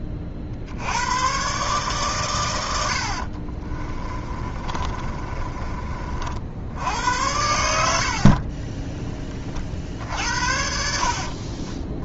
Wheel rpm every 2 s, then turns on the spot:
60, 90, 30, 70, 30, 70.
4-6 10-12